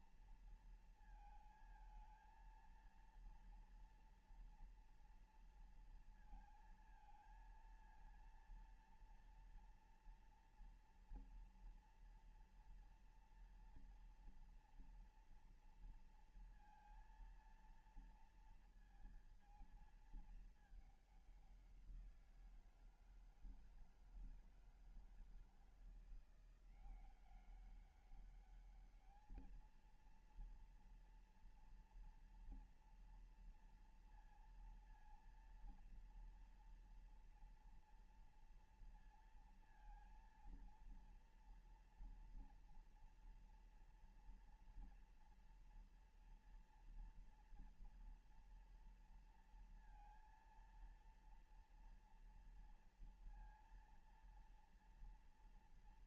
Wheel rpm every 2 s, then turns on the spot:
230, 220, 230, 230, 230, 230, 230, 230, 230, 230, 220, 180, 160, 170, 200, 230, 230, 230, 230, 230, 230, 240, 230, 230, 230, 230, 230, 230.
none